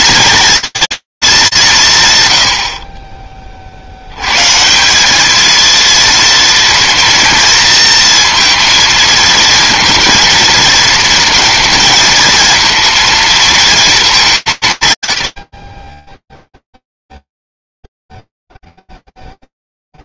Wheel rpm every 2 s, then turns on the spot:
230, 110, 150, 230, 230, 230, 230, 160, 0, 0.
none